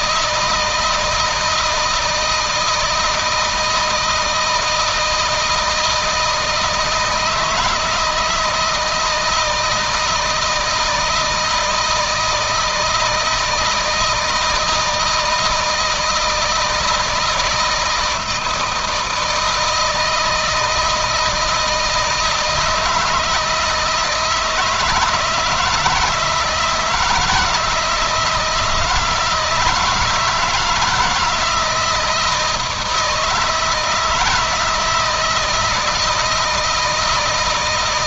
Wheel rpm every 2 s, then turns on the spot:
160, 160, 160, 160, 160, 160, 160, 160, 160, 160, 160, 160, 160, 170, 160, 160, 160, 160, 160.
none